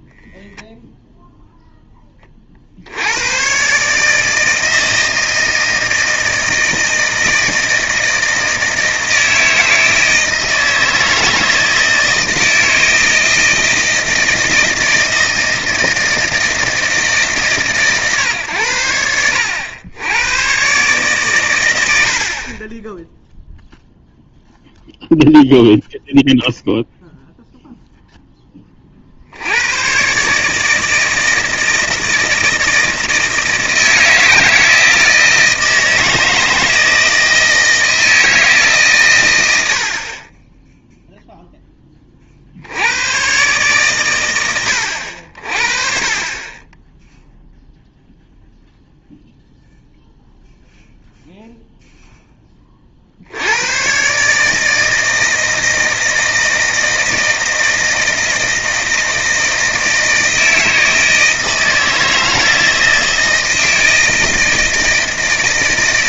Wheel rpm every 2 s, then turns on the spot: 0, 50, 160, 160, 160, 160, 160, 160, 160, 100, 130, 20, 0, 0, 20, 150, 160, 160, 160, 150, 10, 70, 100, 20, 0, 0, 20, 160, 160, 160, 160, 160, 160.
none